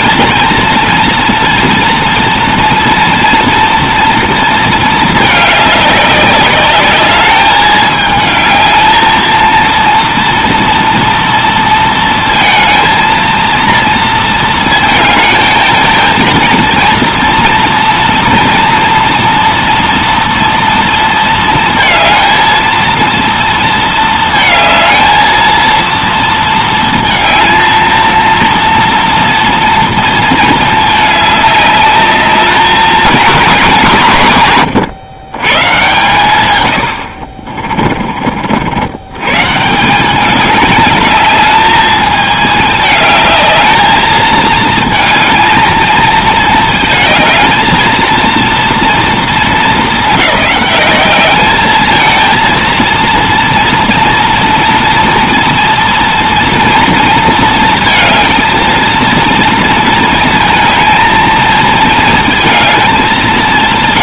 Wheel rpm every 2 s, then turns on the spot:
230, 230, 230, 200, 220, 230, 230, 220, 230, 240, 230, 230, 220, 230, 230, 220, 210, 120, 100, 70, 210, 210, 220, 220, 230, 200, 230, 230, 230, 230, 220, 200.
none